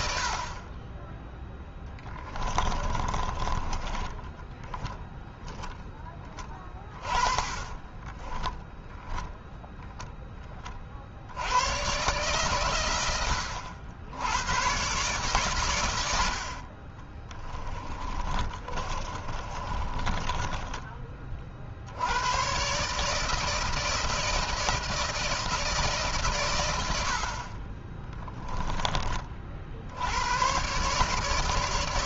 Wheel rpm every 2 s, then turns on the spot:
20, 20, 0, 20, 0, 60, 100, 120, 40, 30, 20, 140, 160, 80, 20, 140.
2-4 6-8 16-20